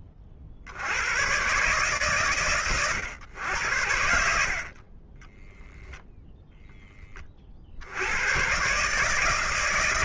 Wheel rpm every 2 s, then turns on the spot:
60, 110, 40, 10, 130.
4-6